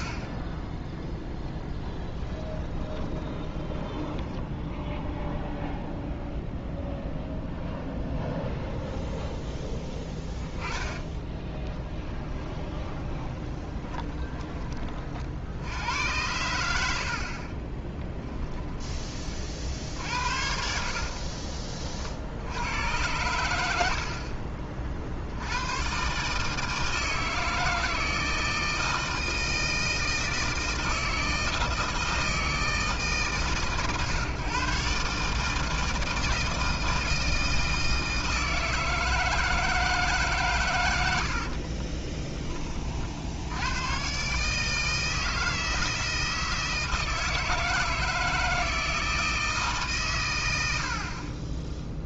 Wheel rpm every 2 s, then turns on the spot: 0, 20, 0, 0, 0, 20, 20, 20, 70, 10, 60, 90, 50, 160, 160, 160, 160, 140, 160, 160, 110, 30, 150, 160, 160, 80.
2-4 10-14 20-22